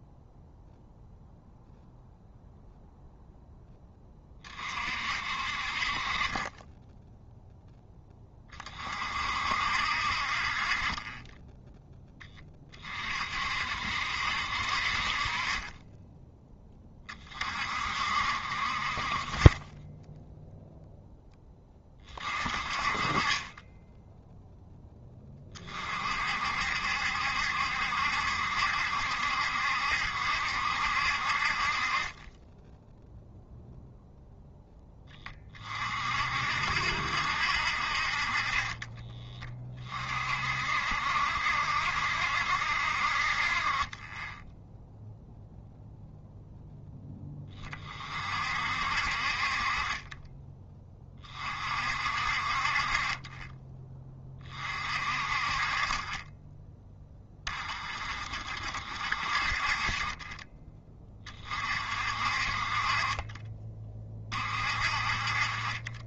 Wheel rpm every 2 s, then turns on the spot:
0, 0, 40, 10, 30, 40, 20, 50, 10, 40, 0, 30, 10, 60, 70, 60, 10, 0, 60, 30, 60, 60, 0, 0, 50, 20, 40, 40, 10, 40, 20, 40, 40.
none